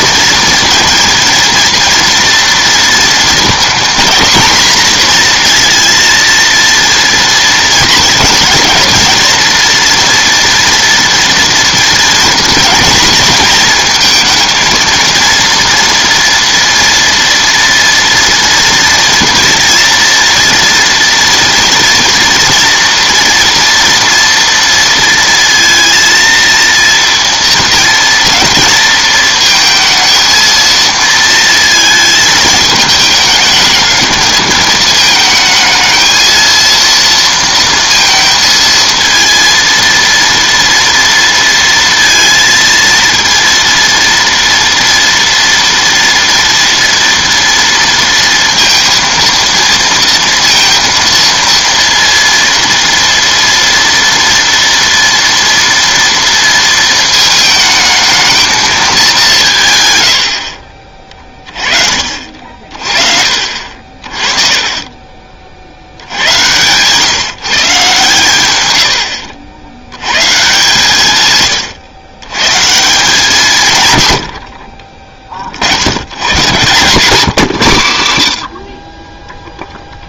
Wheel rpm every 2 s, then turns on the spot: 230, 240, 240, 230, 220, 230, 230, 230, 230, 230, 230, 230, 230, 230, 220, 230, 220, 220, 230, 230, 230, 230, 230, 230, 230, 230, 230, 230, 230, 220, 50, 40, 30, 120, 110, 130, 150, 40, 140, 40.
68-70 76-78